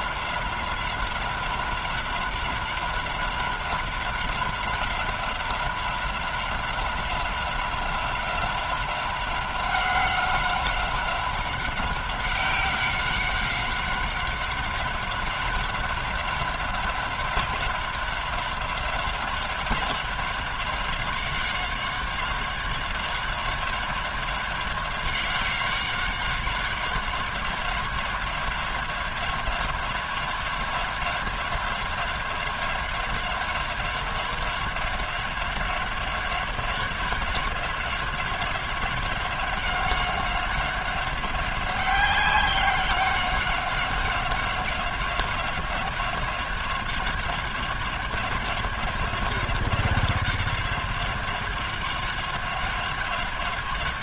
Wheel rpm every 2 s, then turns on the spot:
190, 190, 190, 190, 190, 190, 190, 190, 190, 190, 190, 190, 190, 190, 190, 190, 190, 190, 190, 190, 190, 200, 190, 190, 190, 190, 190.
none